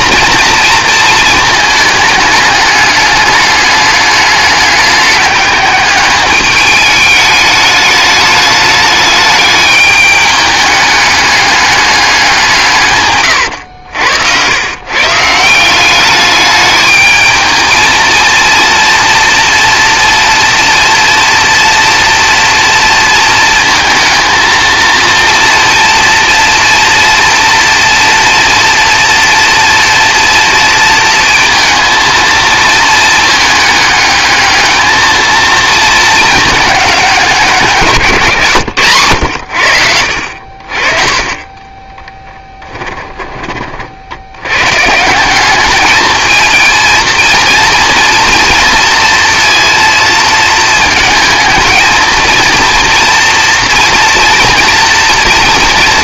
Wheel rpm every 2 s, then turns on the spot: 240, 210, 210, 210, 210, 210, 160, 110, 210, 230, 240, 230, 230, 230, 230, 230, 230, 210, 210, 110, 50, 10, 110, 220, 230, 230, 230, 230.
40-44